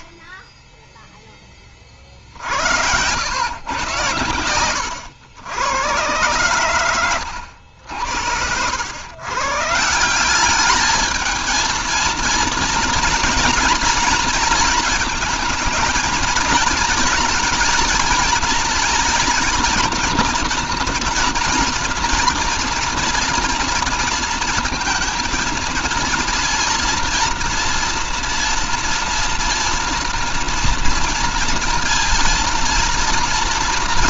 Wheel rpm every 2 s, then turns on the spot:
0, 60, 90, 100, 90, 200, 230, 220, 220, 230, 240, 230, 230, 230, 240, 240, 230.
none